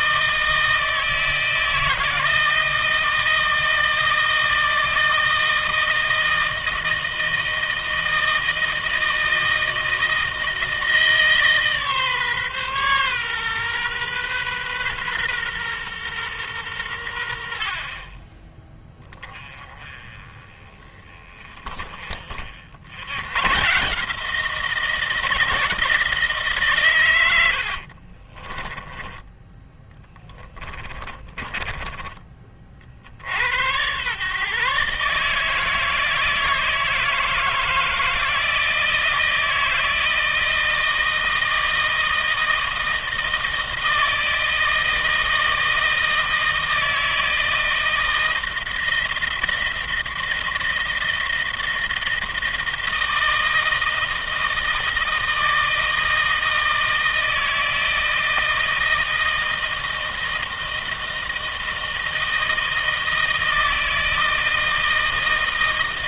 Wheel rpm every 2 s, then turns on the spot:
160, 160, 160, 160, 160, 160, 140, 130, 100, 20, 20, 70, 170, 140, 30, 30, 40, 140, 160, 160, 160, 160, 160, 160, 160, 160, 160, 160, 160, 160, 160, 160, 160.
28-32